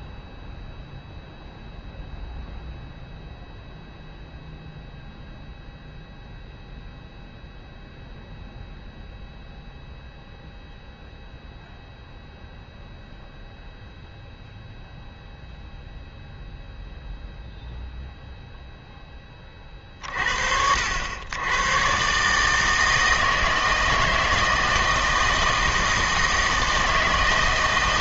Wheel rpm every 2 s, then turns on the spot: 0, 0, 0, 0, 0, 0, 0, 0, 0, 0, 70, 160, 160, 160.
none